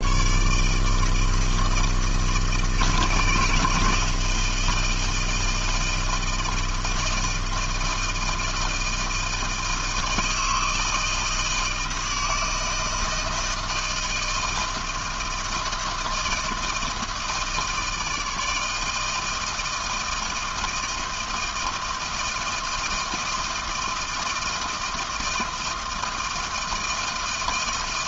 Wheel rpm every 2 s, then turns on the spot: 160, 160, 170, 160, 160, 160, 160, 160, 160, 160, 160, 160, 160, 160.
none